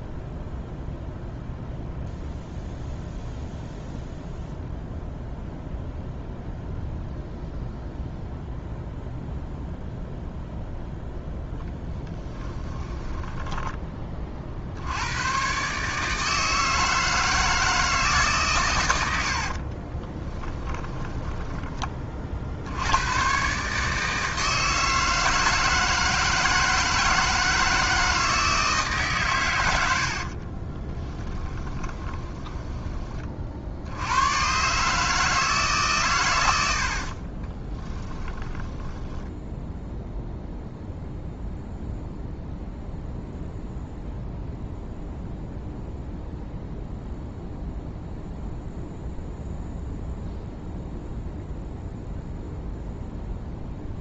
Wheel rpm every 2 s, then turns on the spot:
0, 0, 0, 0, 0, 0, 10, 70, 160, 110, 10, 90, 160, 160, 150, 30, 20, 140, 70, 10, 0, 0, 0, 0, 0, 0, 0.
12-14 20-22 30-32 36-40